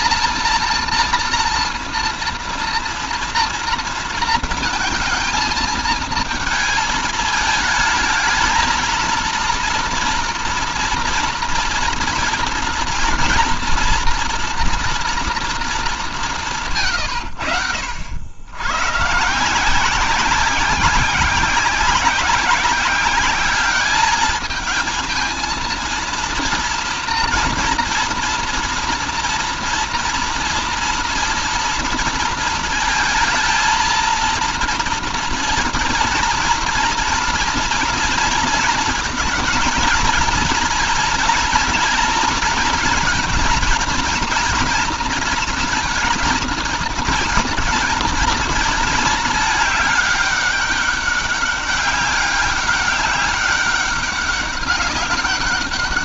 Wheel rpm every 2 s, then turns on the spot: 230, 230, 220, 220, 220, 230, 230, 230, 150, 110, 180, 190, 220, 230, 230, 230, 230, 230, 230, 230, 230, 240, 230, 230, 220, 200, 200, 200.
none